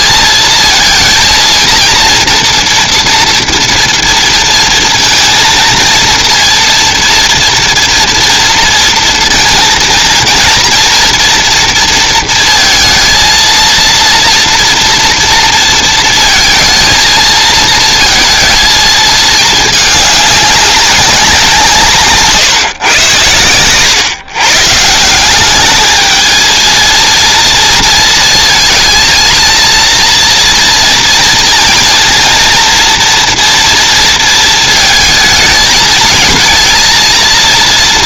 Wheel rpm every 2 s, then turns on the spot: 230, 230, 230, 230, 230, 230, 230, 240, 230, 230, 210, 160, 130, 220, 230, 240, 230, 230, 220.
none